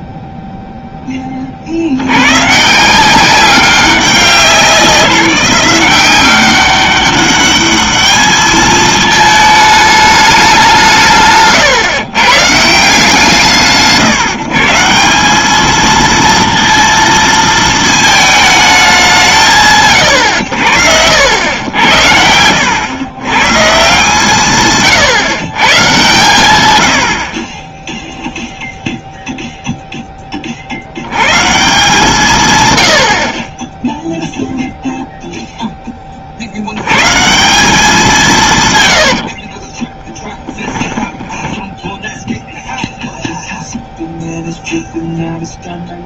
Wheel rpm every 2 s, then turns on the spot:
0, 110, 190, 180, 210, 210, 140, 140, 230, 220, 110, 80, 160, 130, 0, 50, 110, 0, 100, 120, 10, 0, 0.
38-42